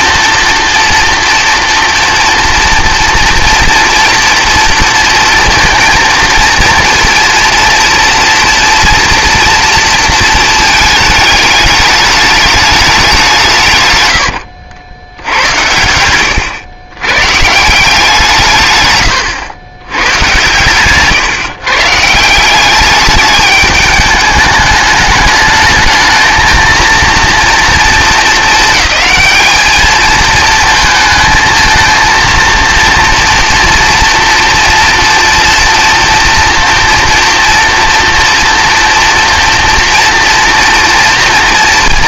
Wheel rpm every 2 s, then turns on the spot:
240, 230, 230, 230, 230, 220, 210, 80, 100, 130, 130, 190, 210, 220, 220, 220, 230, 230, 230, 240, 230.
16-18